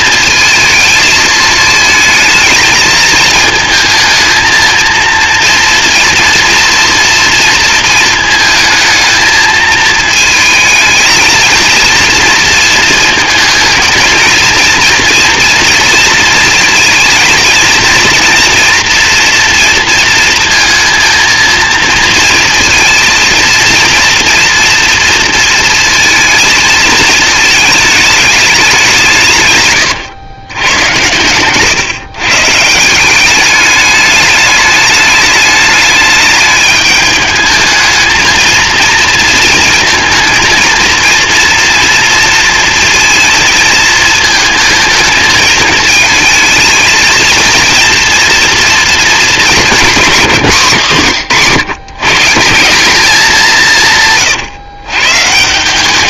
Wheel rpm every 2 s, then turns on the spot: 220, 220, 230, 230, 220, 220, 230, 230, 230, 230, 230, 230, 230, 220, 190, 110, 160, 210, 210, 230, 230, 230, 220, 220, 230, 170, 190, 130.
none